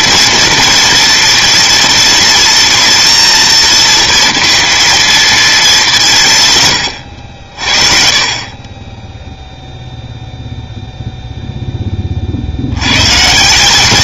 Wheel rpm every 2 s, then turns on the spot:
230, 230, 230, 120, 20, 0, 60.
none